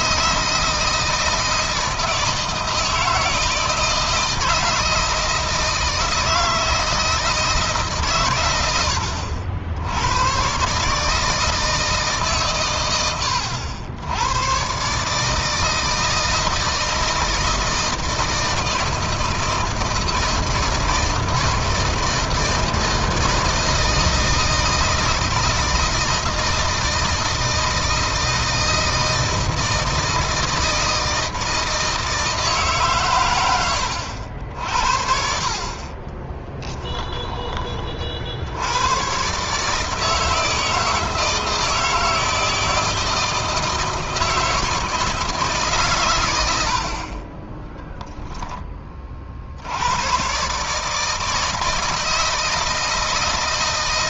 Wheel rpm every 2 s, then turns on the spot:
170, 160, 160, 160, 100, 130, 120, 130, 160, 160, 160, 160, 160, 160, 160, 160, 140, 60, 10, 90, 160, 160, 160, 80, 20, 150, 160.
36-38